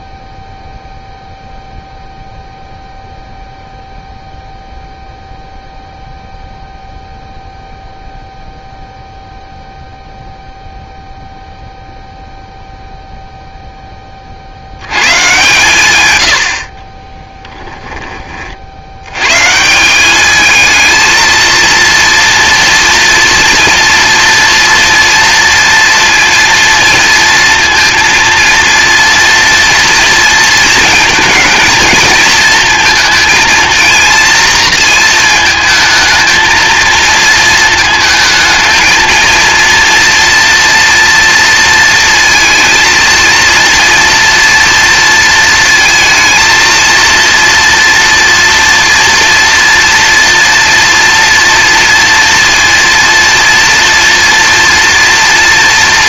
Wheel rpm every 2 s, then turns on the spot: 0, 0, 0, 0, 0, 0, 0, 110, 30, 80, 220, 230, 240, 230, 230, 220, 230, 230, 230, 220, 230, 230, 230, 230, 230, 230, 230, 230.
16-18